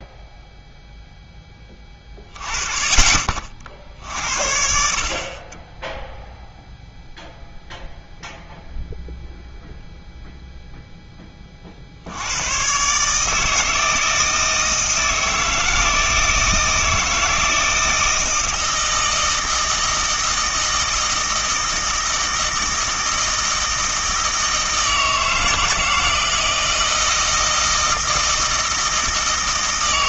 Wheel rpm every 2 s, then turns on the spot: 0, 20, 70, 0, 0, 0, 110, 160, 160, 160, 160, 160, 160, 160, 160.
none